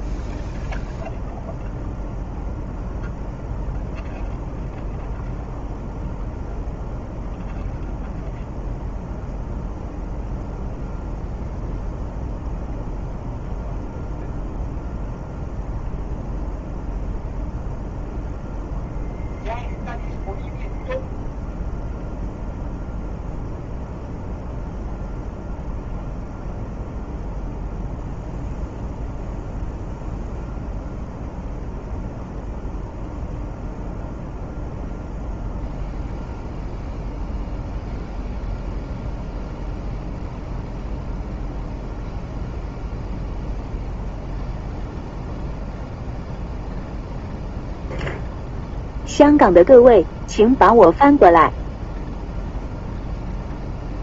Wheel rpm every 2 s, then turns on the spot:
0, 0, 0, 0, 0, 0, 0, 0, 0, 0, 0, 0, 0, 0, 0, 0, 0, 0, 0, 0, 0, 0, 0, 0, 0, 0, 0.
none